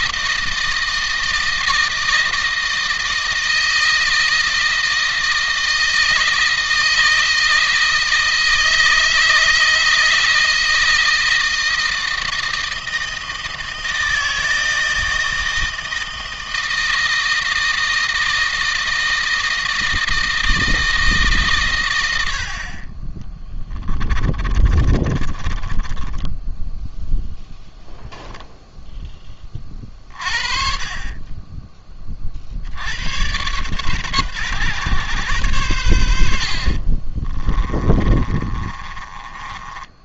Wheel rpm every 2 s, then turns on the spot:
160, 160, 160, 160, 160, 160, 160, 160, 160, 160, 160, 30, 30, 0, 0, 30, 80, 120, 50, 30.
22-26 36-40